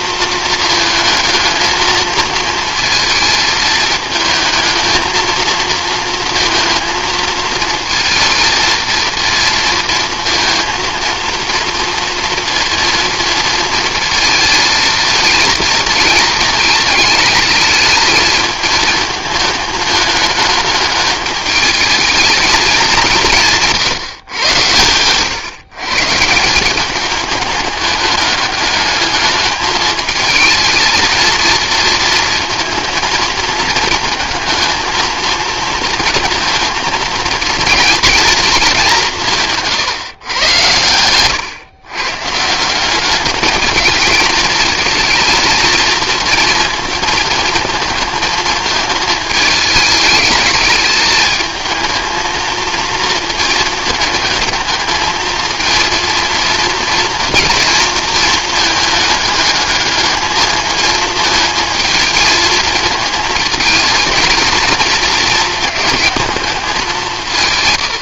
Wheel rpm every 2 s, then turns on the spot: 220, 220, 220, 230, 230, 230, 230, 220, 220, 220, 220, 200, 120, 180, 210, 220, 230, 220, 230, 200, 110, 180, 220, 230, 220, 210, 230, 220, 230, 220, 220, 220, 220, 190.
none